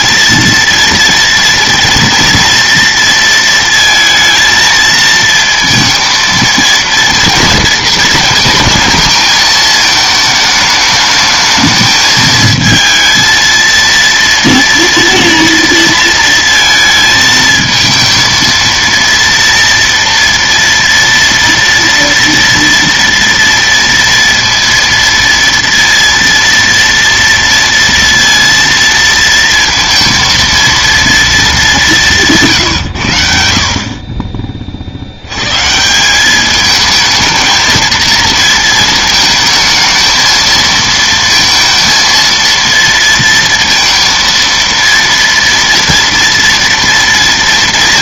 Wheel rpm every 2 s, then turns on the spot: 230, 230, 230, 230, 220, 220, 220, 230, 230, 230, 230, 230, 230, 230, 230, 230, 150, 40, 210, 220, 220, 230, 230, 230.
none